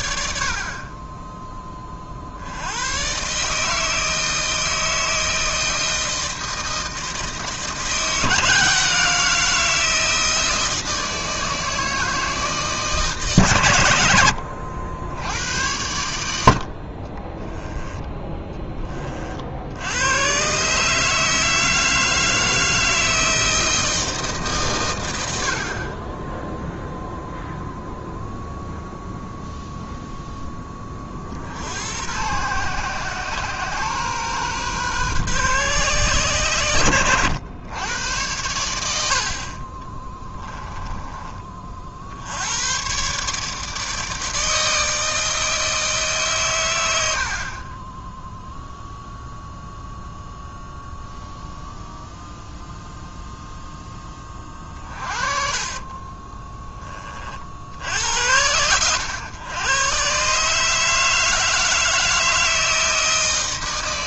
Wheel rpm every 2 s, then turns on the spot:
40, 110, 160, 160, 160, 160, 150, 70, 50, 20, 140, 160, 120, 0, 0, 20, 120, 130, 100, 90, 20, 110, 160, 90, 0, 0, 0, 30, 20, 110, 160, 160.
40-42